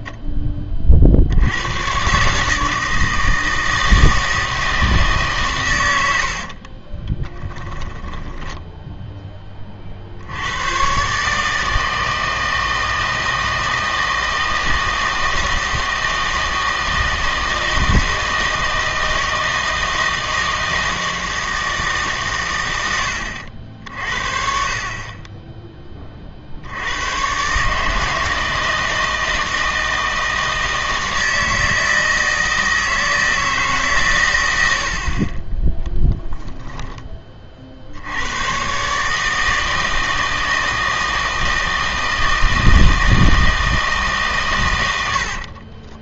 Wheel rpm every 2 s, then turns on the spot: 20, 150, 160, 50, 10, 100, 160, 160, 160, 160, 160, 120, 50, 70, 160, 160, 160, 90, 0, 120, 160, 160, 120.
6-10